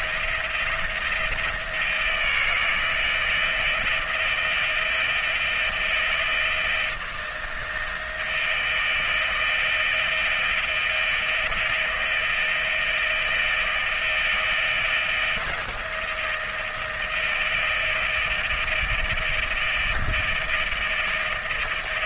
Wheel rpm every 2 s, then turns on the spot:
170, 160, 160, 170, 160, 160, 170, 160, 160, 160, 160.
none